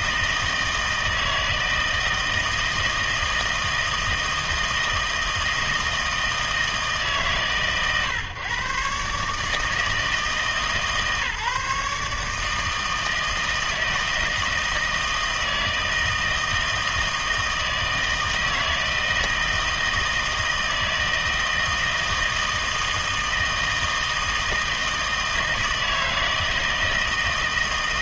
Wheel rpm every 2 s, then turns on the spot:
160, 160, 160, 160, 140, 150, 160, 160, 160, 160, 160, 160, 160, 160.
none